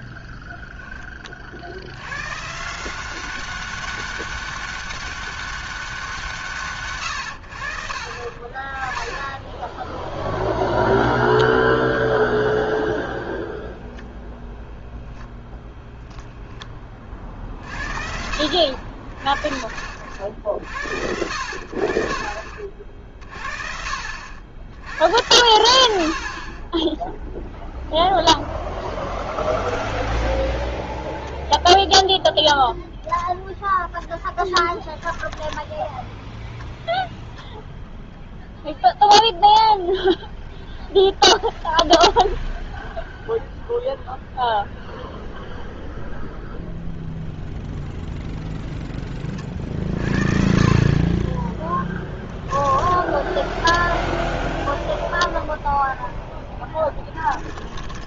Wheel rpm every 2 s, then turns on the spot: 10, 170, 200, 140, 20, 0, 0, 0, 30, 50, 80, 50, 100, 10, 0, 0, 10, 10, 0, 0, 0, 0, 0, 0, 10, 40, 10, 0, 10.
34-36 52-54 56-58